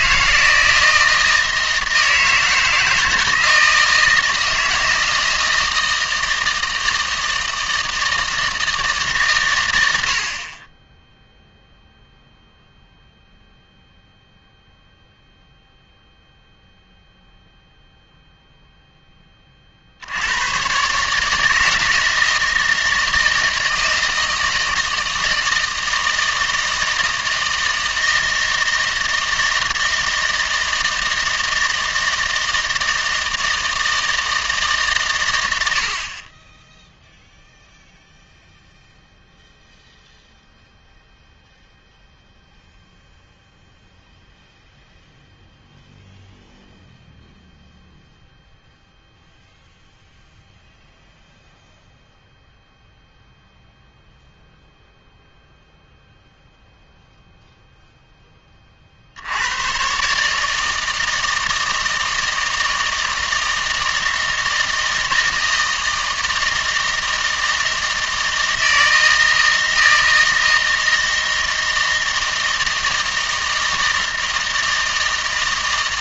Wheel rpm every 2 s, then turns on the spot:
170, 160, 160, 160, 160, 20, 0, 0, 0, 0, 120, 160, 160, 160, 160, 160, 160, 140, 10, 0, 0, 0, 0, 0, 0, 0, 0, 0, 0, 30, 160, 160, 160, 160, 160, 160, 160, 160.
none